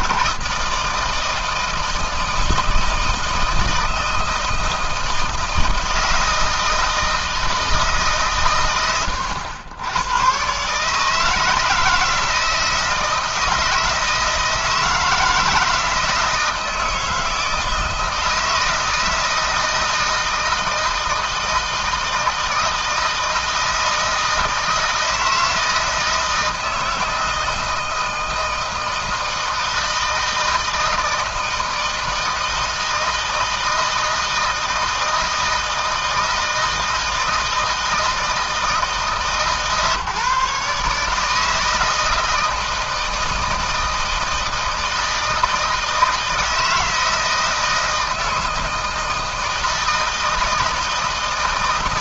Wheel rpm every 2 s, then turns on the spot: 150, 160, 160, 160, 110, 140, 160, 160, 160, 160, 160, 160, 160, 160, 160, 160, 160, 160, 160, 160, 150, 160, 160, 160, 160, 160.
none